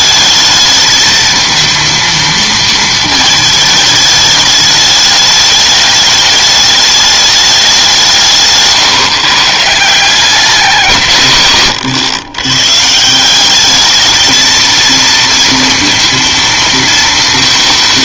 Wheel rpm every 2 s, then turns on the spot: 220, 220, 210, 210, 140, 170, 140, 220, 230.
none